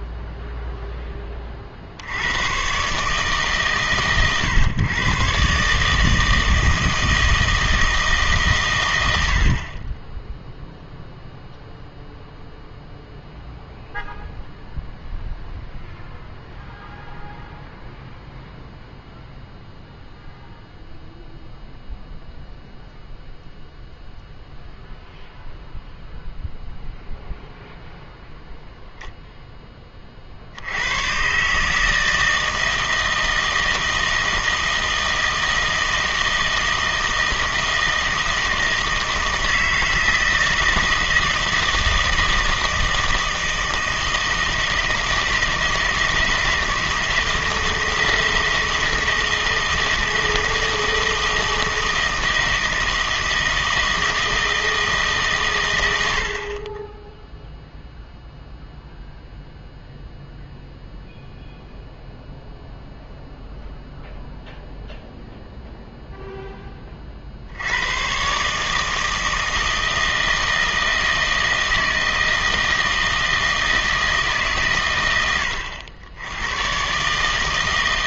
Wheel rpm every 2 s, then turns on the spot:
0, 120, 120, 160, 120, 0, 0, 0, 0, 0, 0, 0, 0, 0, 0, 80, 160, 160, 160, 160, 160, 160, 160, 160, 160, 160, 160, 160, 30, 0, 0, 0, 0, 20, 150, 160, 160, 130, 120.
none